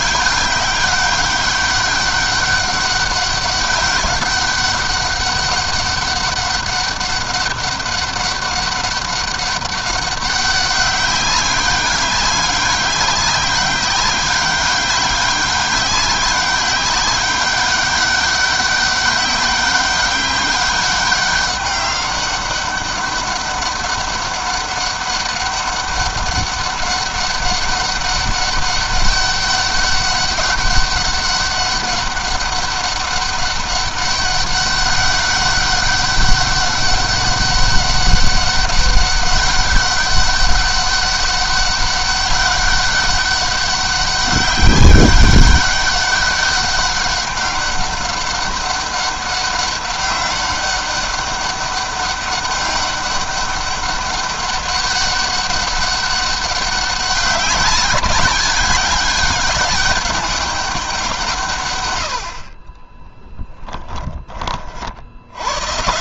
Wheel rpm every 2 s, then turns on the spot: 200, 200, 200, 200, 200, 200, 200, 190, 200, 200, 200, 200, 190, 200, 200, 200, 200, 200, 200, 200, 200, 200, 200, 200, 200, 200, 200, 200, 200, 200, 200, 50, 30.
none